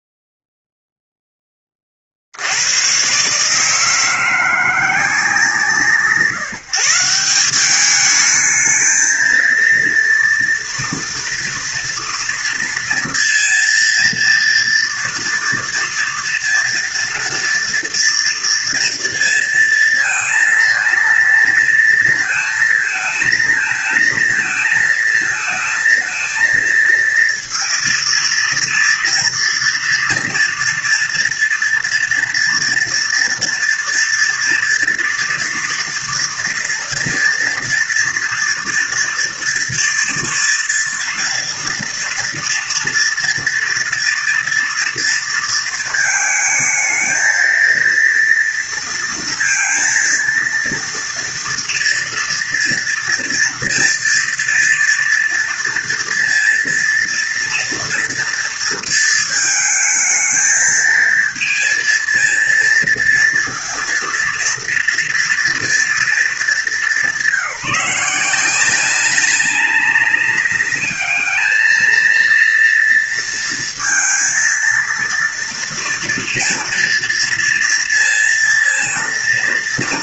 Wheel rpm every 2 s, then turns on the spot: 0, 120, 170, 160, 220, 230, 230, 230, 230, 230, 230, 220, 220, 230, 230, 230, 230, 230, 230, 230, 230, 230, 230, 220, 230, 230, 230, 230, 230, 230, 220, 230, 230, 190, 190, 210, 230, 230, 240, 230.
none